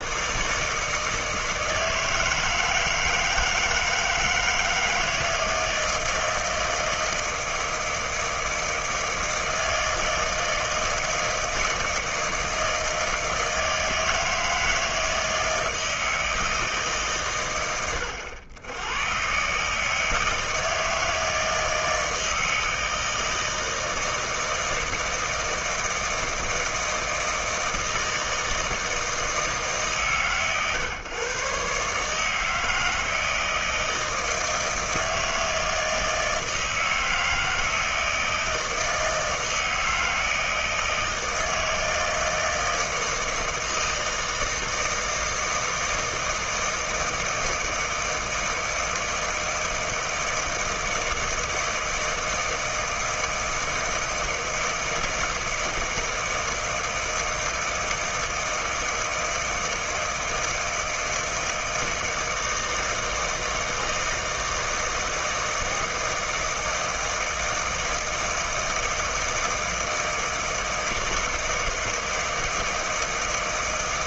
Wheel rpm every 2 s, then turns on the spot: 150, 160, 160, 160, 160, 160, 160, 160, 160, 100, 160, 160, 160, 160, 160, 120, 160, 160, 160, 160, 160, 160, 160, 160, 160, 160, 160, 160, 160, 160, 160, 160, 160, 160, 160, 160, 160.
none